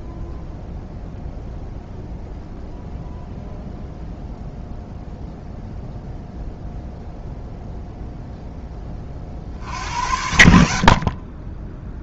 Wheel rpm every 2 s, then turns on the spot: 0, 0, 0, 0, 20, 60.
none